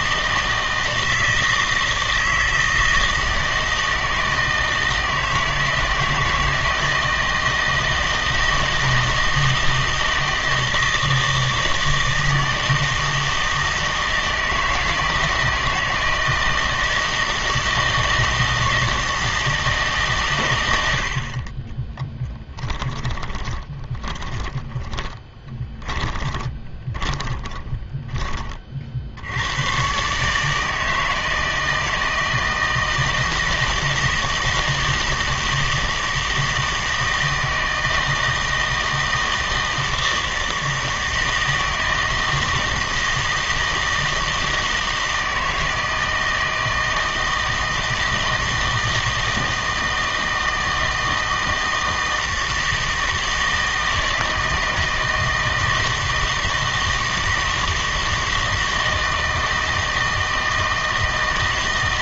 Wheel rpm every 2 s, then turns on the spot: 160, 160, 160, 160, 160, 160, 160, 160, 160, 160, 90, 20, 20, 20, 50, 160, 160, 160, 160, 160, 160, 160, 160, 160, 160, 160, 160, 160, 160, 160, 160.
22-28